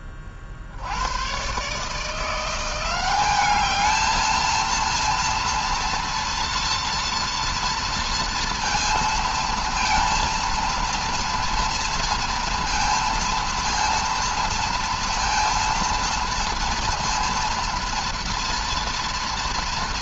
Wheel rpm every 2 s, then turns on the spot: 80, 180, 230, 230, 240, 230, 230, 230, 230, 230.
none